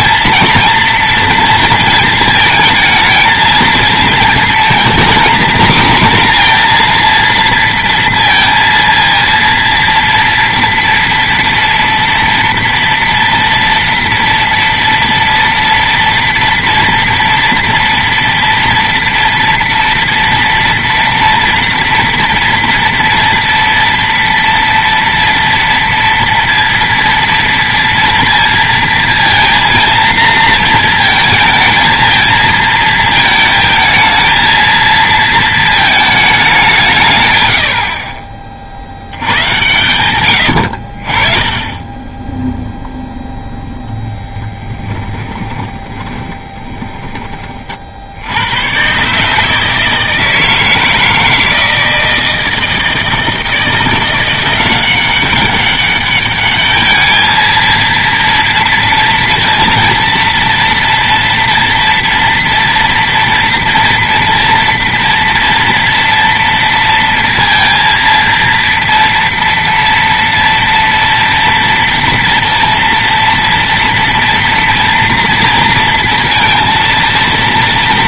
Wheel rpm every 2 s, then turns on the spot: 230, 220, 230, 240, 230, 230, 230, 230, 230, 230, 230, 230, 230, 230, 230, 230, 230, 230, 180, 50, 80, 0, 10, 20, 100, 160, 160, 180, 210, 230, 230, 230, 230, 230, 230, 230, 230, 230, 230.
44-48